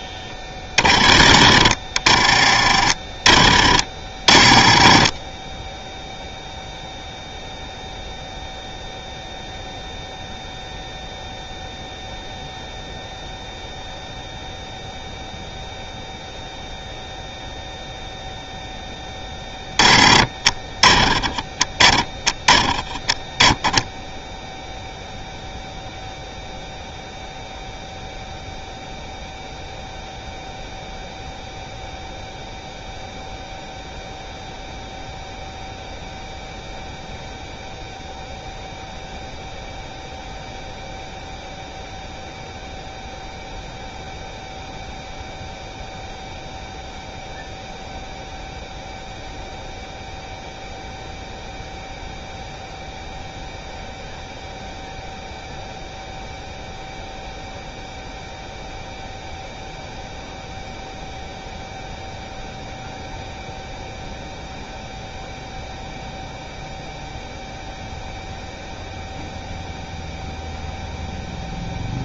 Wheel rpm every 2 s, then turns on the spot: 30, 30, 20, 0, 0, 0, 0, 0, 0, 0, 30, 20, 0, 0, 0, 0, 0, 0, 0, 0, 0, 0, 0, 0, 0, 0, 0, 0, 0, 0, 0, 0, 0, 0, 0, 0.
none